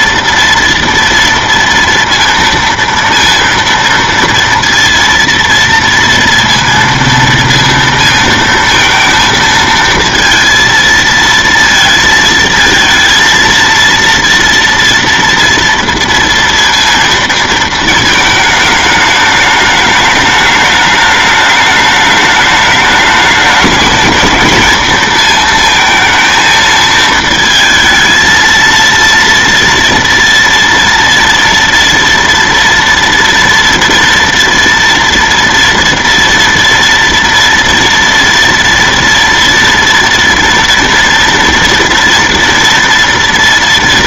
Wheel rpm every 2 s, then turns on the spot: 230, 230, 230, 230, 230, 230, 230, 230, 230, 220, 210, 210, 230, 220, 230, 230, 230, 230, 230, 240, 230, 240.
none